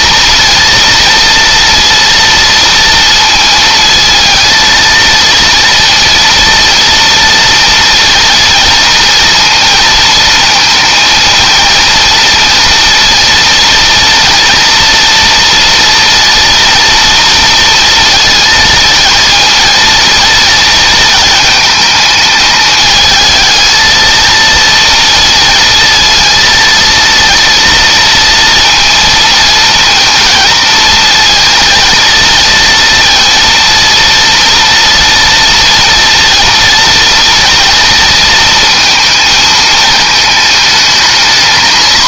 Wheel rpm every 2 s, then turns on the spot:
230, 230, 230, 230, 240, 230, 230, 230, 230, 220, 220, 220, 230, 230, 230, 230, 230, 230, 230, 230, 220.
none